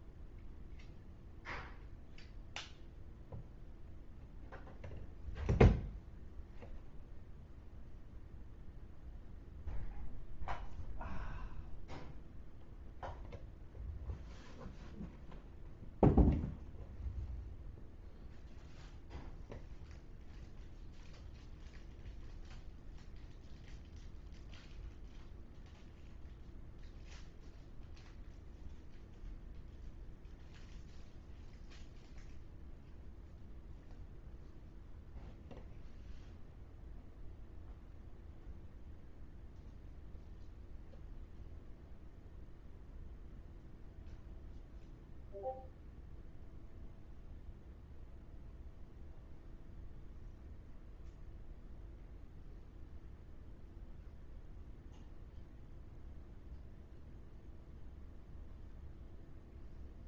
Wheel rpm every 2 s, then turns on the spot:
0, 0, 0, 0, 0, 0, 0, 0, 0, 0, 0, 0, 0, 0, 0, 0, 0, 0, 0, 0, 0, 0, 0, 0, 0, 0, 0, 0, 0, 0.
none